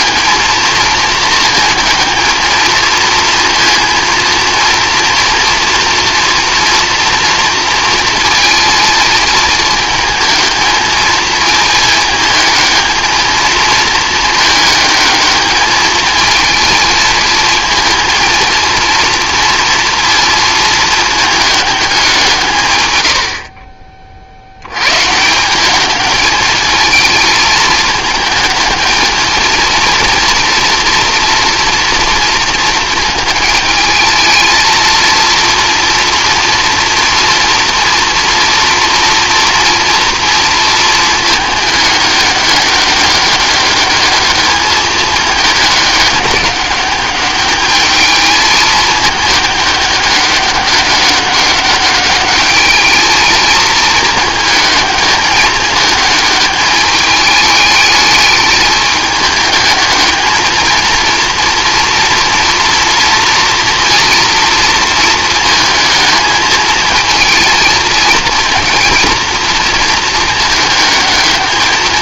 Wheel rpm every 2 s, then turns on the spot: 220, 220, 230, 230, 230, 220, 220, 220, 230, 230, 220, 140, 90, 220, 220, 230, 230, 230, 230, 230, 230, 200, 210, 200, 220, 200, 210, 220, 210, 210, 220, 230, 230, 220, 230, 220.
none